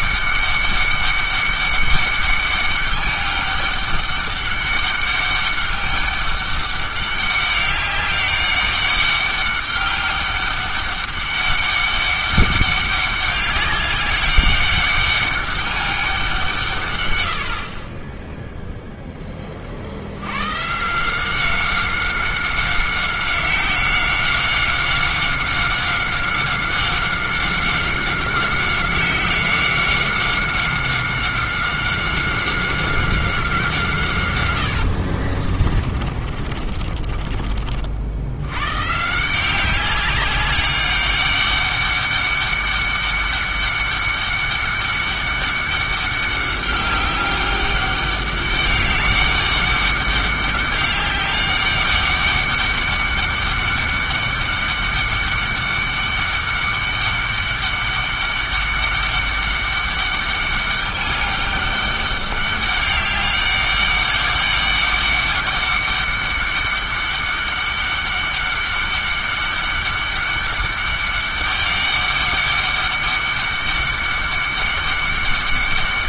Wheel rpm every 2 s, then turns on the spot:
200, 200, 200, 200, 200, 200, 200, 200, 140, 0, 160, 190, 190, 190, 190, 190, 190, 70, 40, 120, 200, 200, 200, 200, 200, 200, 200, 200, 200, 200, 200, 200, 200, 200, 200, 200, 200, 200.
34-38